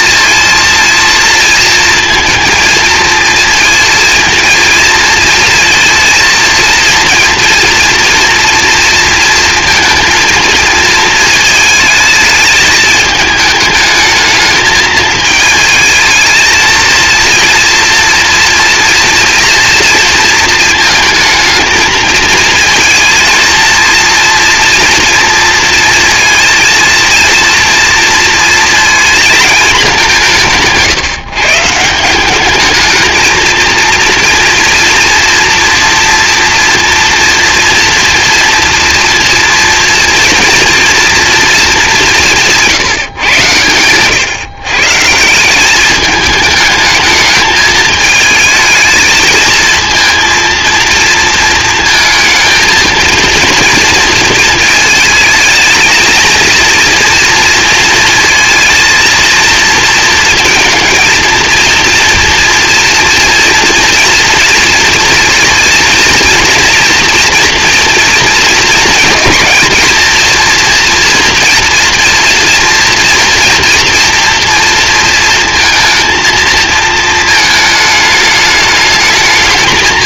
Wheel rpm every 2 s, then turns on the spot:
230, 230, 230, 230, 230, 220, 220, 220, 230, 230, 220, 220, 230, 230, 230, 160, 220, 230, 230, 230, 230, 150, 150, 220, 220, 230, 230, 220, 230, 230, 230, 230, 230, 230, 220, 230, 240, 230, 220, 210.
none